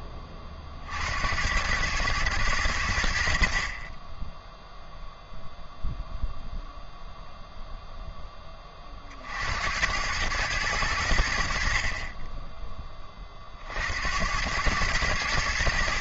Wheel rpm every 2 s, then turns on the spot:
80, 0, 0, 40, 100, 20, 110, 90.
none